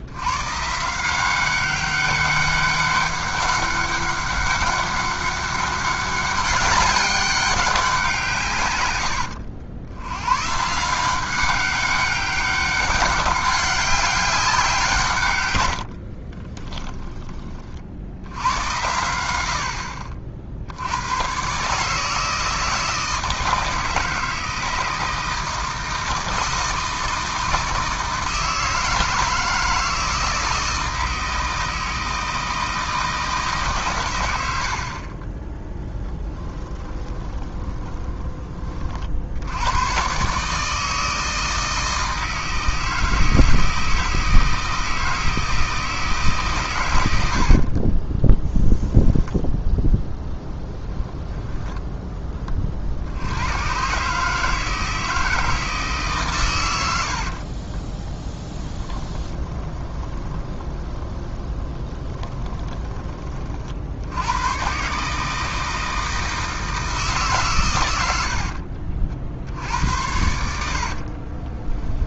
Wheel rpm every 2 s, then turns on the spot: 140, 200, 200, 200, 120, 150, 200, 170, 20, 100, 80, 160, 160, 160, 160, 160, 160, 60, 10, 30, 150, 160, 160, 130, 0, 10, 40, 160, 100, 20, 20, 20, 120, 160, 50, 70.
16-18 34-38 58-64 68-72